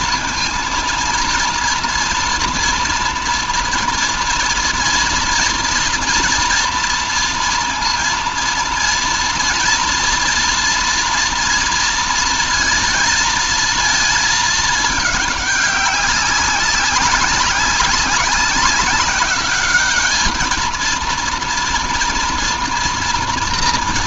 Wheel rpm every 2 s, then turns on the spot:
230, 240, 230, 230, 230, 230, 230, 210, 200, 200, 230, 230.
none